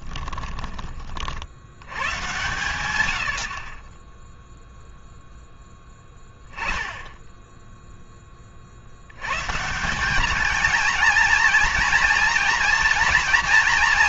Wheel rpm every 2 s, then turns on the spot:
20, 120, 0, 10, 40, 220, 230.
none